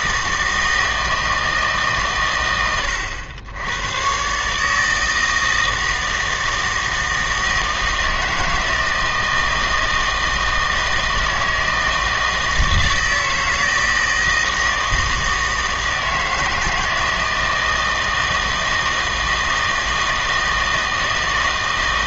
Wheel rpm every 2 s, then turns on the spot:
160, 100, 140, 160, 160, 160, 160, 160, 160, 160, 160.
none